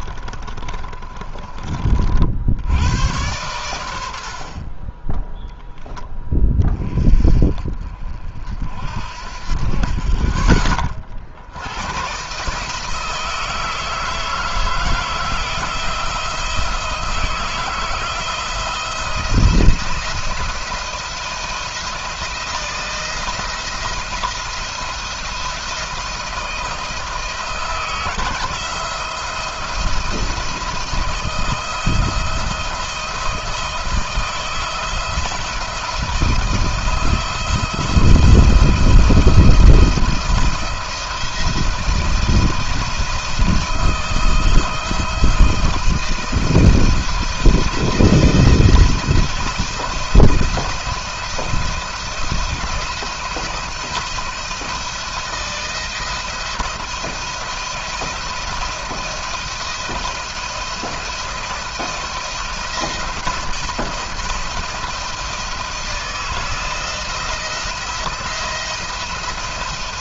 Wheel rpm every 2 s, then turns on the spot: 40, 90, 30, 20, 50, 30, 150, 160, 170, 170, 170, 170, 170, 160, 170, 170, 170, 170, 170, 160, 170, 160, 170, 170, 160, 170, 170, 170, 170, 170, 170, 170, 170, 160, 170.
0-2